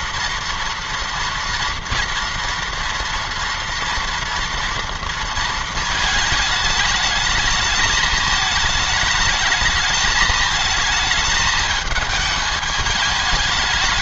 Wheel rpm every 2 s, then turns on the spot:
230, 230, 230, 210, 220, 220, 210.
none